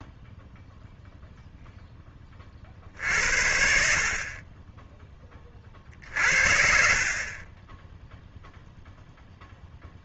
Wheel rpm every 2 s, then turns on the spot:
0, 60, 20, 50, 0.
none